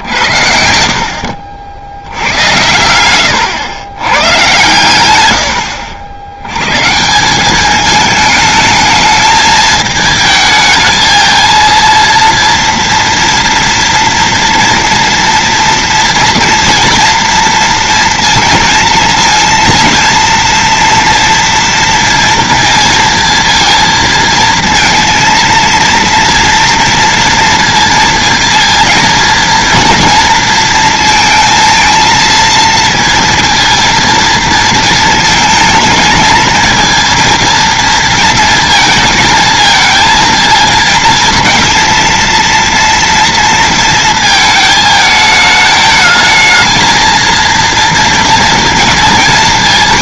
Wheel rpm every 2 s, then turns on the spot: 70, 110, 110, 110, 220, 220, 230, 230, 230, 230, 230, 230, 230, 230, 230, 230, 230, 230, 220, 230, 230, 230, 220, 220, 230.
none